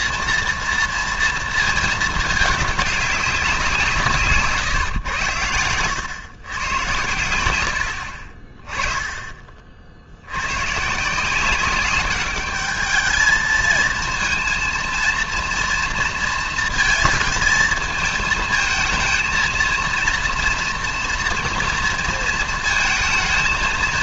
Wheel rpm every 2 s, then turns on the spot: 230, 210, 140, 110, 20, 120, 210, 230, 220, 220, 230, 230.
none